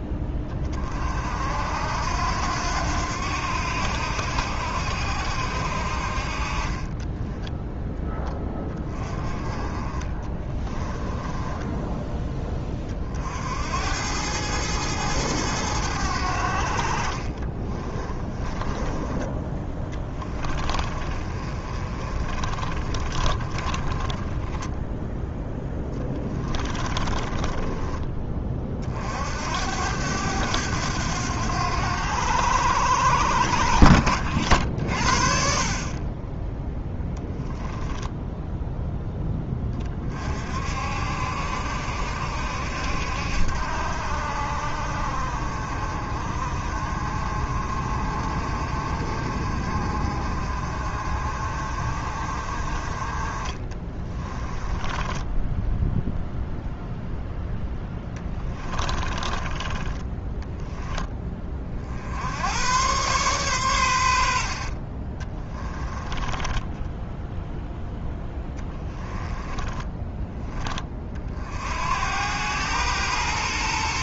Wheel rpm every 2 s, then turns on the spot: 30, 90, 70, 30, 20, 20, 30, 110, 60, 20, 30, 40, 10, 20, 50, 90, 90, 50, 10, 0, 60, 70, 60, 50, 50, 50, 40, 20, 0, 20, 10, 110, 60, 10, 10, 20, 110.
6-8 10-12 18-24 26-28 54-56 58-60 64-70